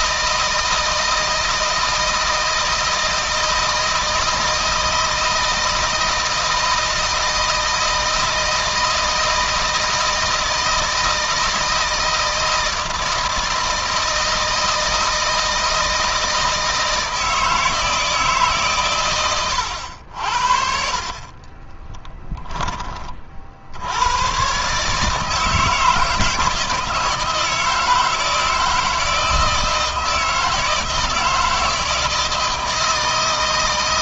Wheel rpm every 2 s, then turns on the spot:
160, 160, 160, 160, 160, 160, 160, 160, 160, 140, 60, 20, 140, 160, 160, 160, 160.
none